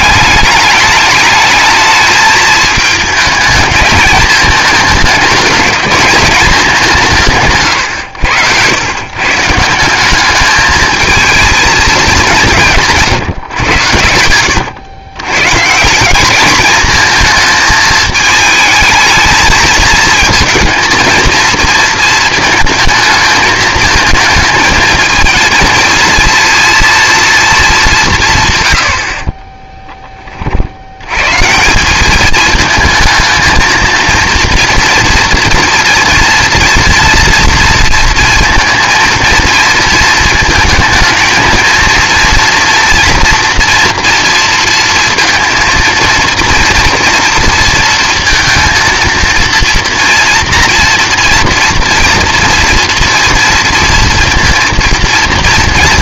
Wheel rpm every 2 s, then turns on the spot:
210, 220, 220, 200, 100, 210, 160, 100, 220, 220, 230, 220, 230, 230, 110, 70, 220, 230, 230, 230, 220, 230, 230, 230, 230, 230, 230, 230.
none